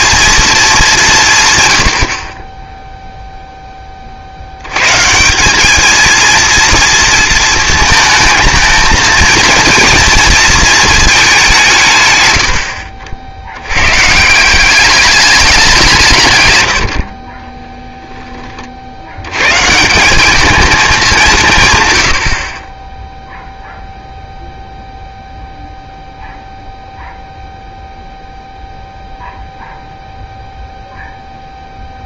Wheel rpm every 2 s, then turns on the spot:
210, 10, 90, 230, 220, 220, 80, 180, 110, 30, 210, 40, 0, 0, 0, 0.
none